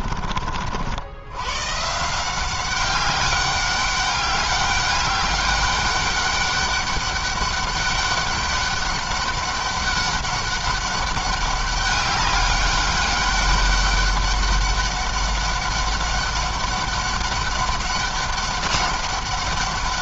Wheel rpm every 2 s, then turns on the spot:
60, 180, 200, 200, 200, 200, 200, 200, 200, 200.
none